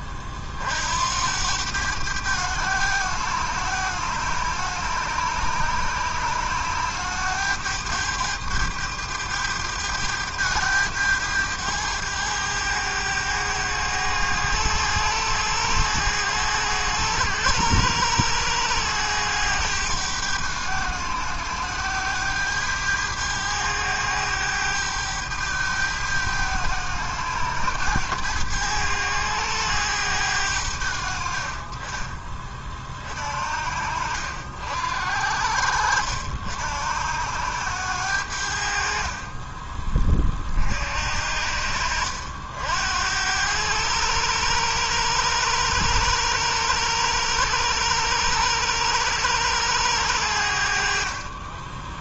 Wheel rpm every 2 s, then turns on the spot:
40, 100, 100, 100, 100, 100, 100, 100, 100, 100, 100, 100, 100, 100, 100, 90, 30, 70, 70, 60, 50, 70, 100, 100, 100, 70.
none